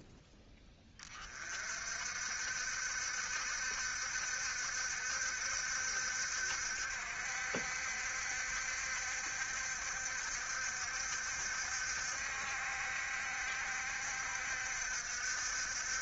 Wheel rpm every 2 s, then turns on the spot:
20, 70, 70, 60, 70, 70, 60, 70.
none